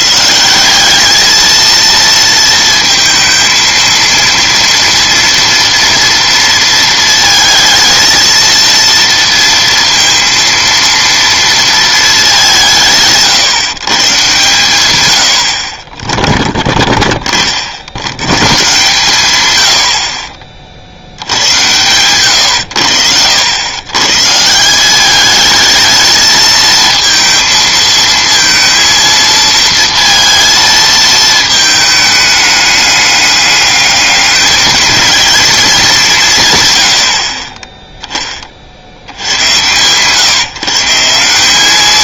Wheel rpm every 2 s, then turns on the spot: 180, 230, 230, 230, 230, 230, 180, 120, 10, 130, 60, 90, 180, 220, 230, 230, 210, 220, 130, 40, 150.
none